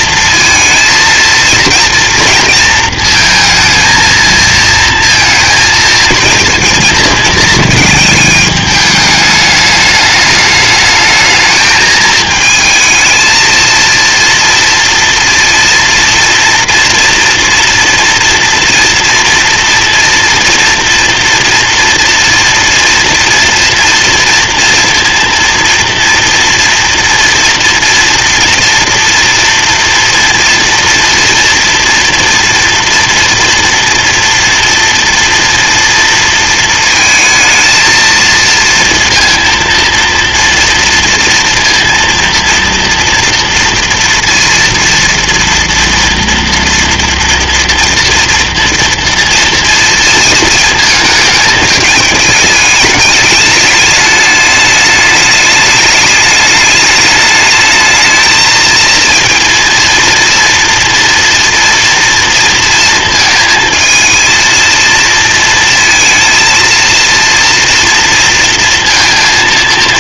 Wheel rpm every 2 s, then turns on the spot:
230, 230, 230, 220, 210, 210, 220, 230, 230, 230, 230, 240, 230, 230, 230, 230, 230, 240, 220, 230, 230, 230, 230, 230, 230, 220, 210, 210, 210, 220, 230, 230, 220, 230, 230.
none